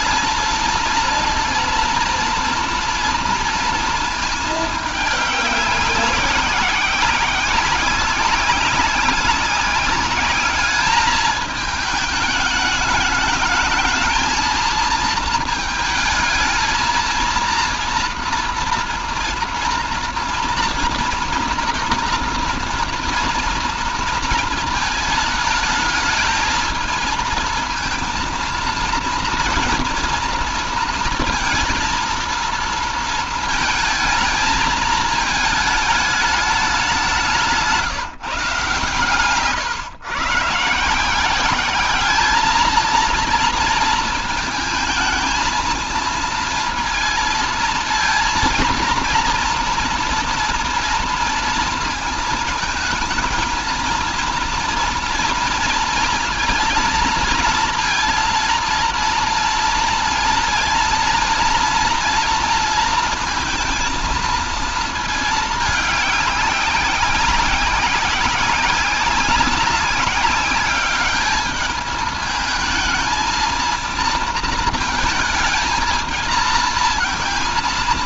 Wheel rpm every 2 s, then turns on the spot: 230, 240, 220, 190, 190, 200, 210, 220, 230, 230, 240, 230, 220, 220, 230, 230, 230, 220, 200, 150, 150, 220, 220, 230, 230, 230, 220, 230, 220, 230, 230, 230, 220, 190, 190, 200, 220, 230, 220.
none